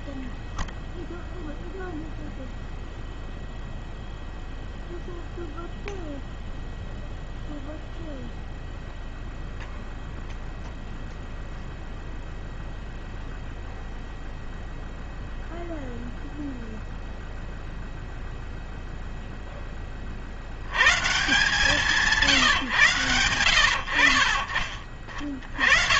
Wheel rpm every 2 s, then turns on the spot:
0, 0, 0, 0, 0, 0, 0, 0, 0, 0, 90, 130, 50.
none